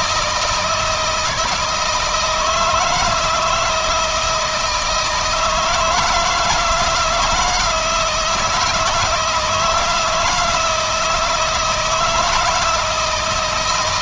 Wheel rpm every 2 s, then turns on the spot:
160, 160, 160, 160, 160, 160, 170.
none